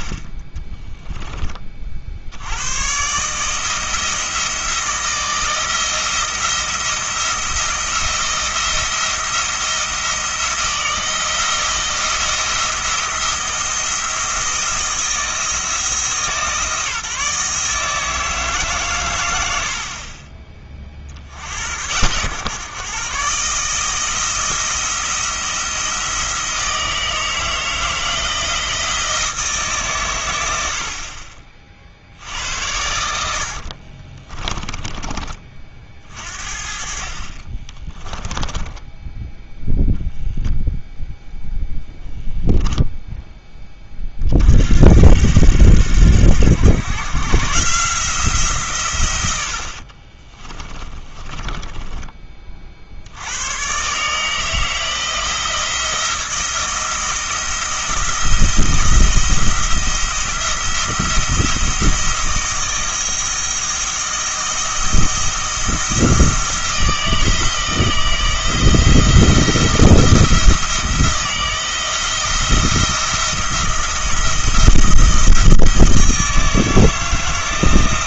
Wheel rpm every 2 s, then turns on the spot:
20, 110, 160, 170, 170, 160, 170, 160, 150, 140, 40, 130, 160, 160, 170, 70, 90, 20, 50, 10, 0, 10, 70, 100, 150, 30, 50, 160, 170, 170, 170, 170, 170, 170, 160, 160, 170, 170, 170.
0-2 34-36 38-40 50-52